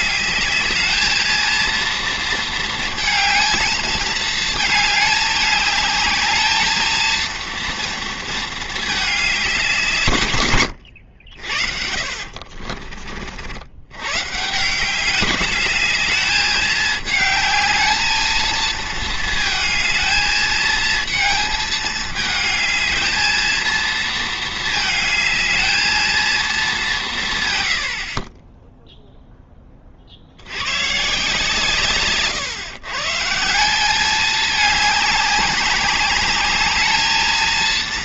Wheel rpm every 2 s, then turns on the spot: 210, 220, 220, 220, 220, 100, 40, 170, 210, 220, 220, 220, 220, 220, 10, 110, 130, 210, 210.
12-14